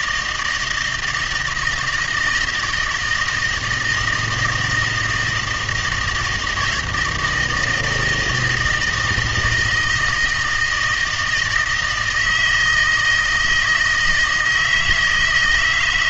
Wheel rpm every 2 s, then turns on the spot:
170, 160, 160, 160, 160, 160, 160, 160.
none